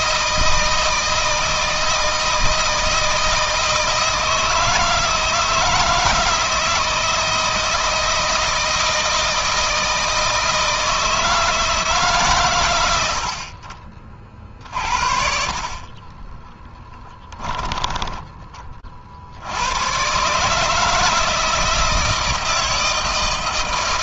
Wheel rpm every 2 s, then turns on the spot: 160, 160, 160, 160, 160, 160, 90, 40, 10, 40, 150, 160.
16-18